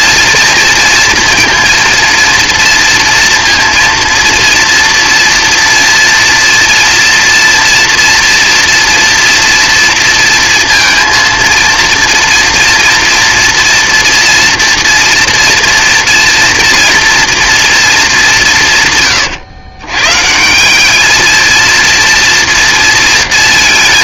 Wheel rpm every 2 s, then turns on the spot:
240, 230, 230, 240, 230, 230, 230, 230, 230, 170, 170, 230.
none